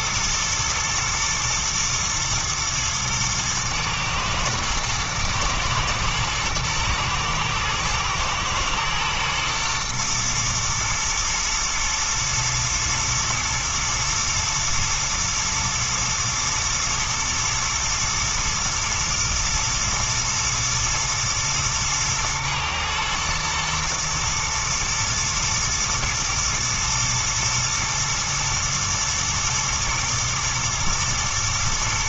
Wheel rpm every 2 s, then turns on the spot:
120, 110, 110, 110, 110, 120, 110, 120, 120, 110, 110, 110, 120, 120, 110, 120.
none